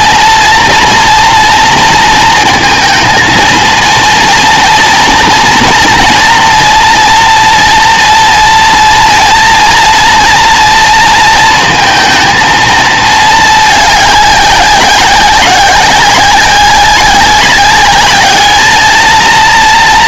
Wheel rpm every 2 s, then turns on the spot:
230, 230, 230, 230, 230, 230, 230, 200, 190, 220.
none